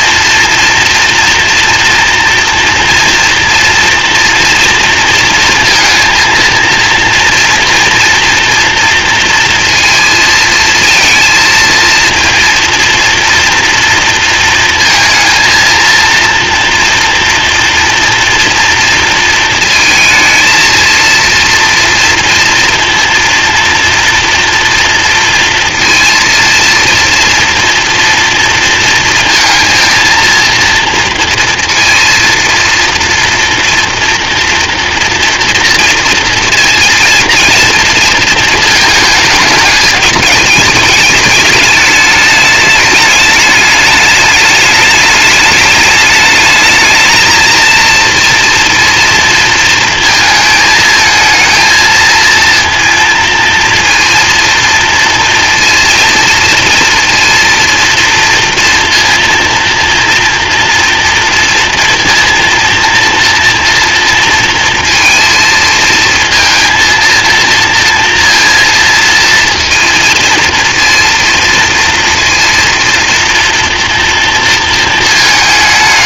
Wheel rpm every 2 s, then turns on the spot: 240, 240, 230, 230, 230, 220, 230, 230, 240, 230, 230, 230, 230, 230, 230, 230, 230, 230, 230, 220, 220, 210, 210, 220, 230, 220, 230, 230, 230, 230, 240, 230, 230, 230, 230, 230, 230, 230.
none